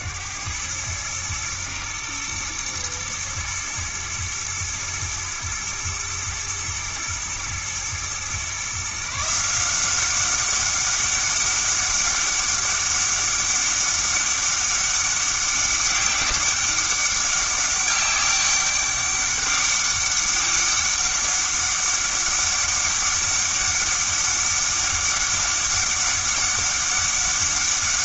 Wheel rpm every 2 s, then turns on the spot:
100, 120, 120, 120, 140, 200, 200, 200, 200, 200, 200, 200, 200, 200.
none